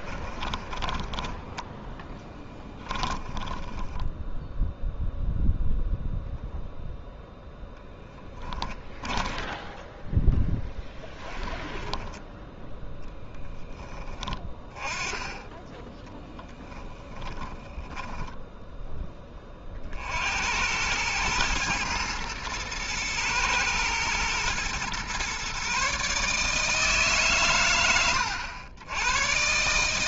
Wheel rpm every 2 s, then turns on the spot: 20, 10, 0, 0, 10, 10, 10, 20, 10, 10, 90, 110, 120, 160, 90.
0-4 8-12 16-18